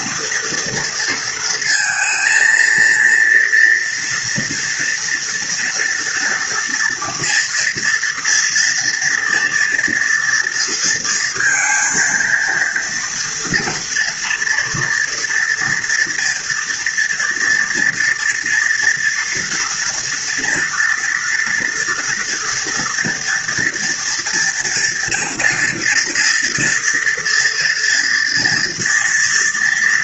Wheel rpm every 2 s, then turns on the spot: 230, 230, 240, 230, 230, 230, 230, 230, 230, 230, 230, 230, 230, 230, 240.
none